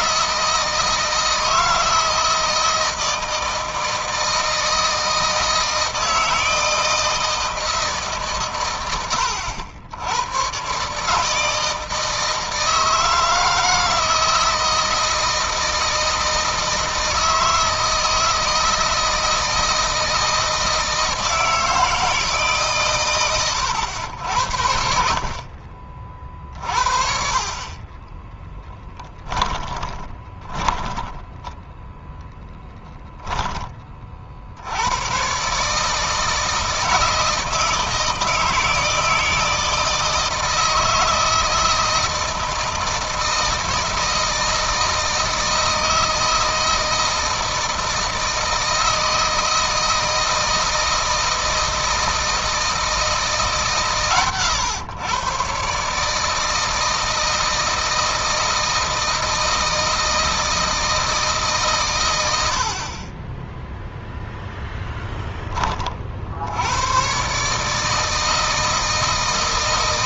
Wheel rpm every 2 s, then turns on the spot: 160, 160, 160, 160, 110, 130, 160, 160, 160, 160, 160, 130, 70, 50, 10, 10, 10, 90, 160, 160, 160, 160, 160, 160, 160, 160, 160, 120, 160, 160, 160, 40, 10, 110, 160.
28-34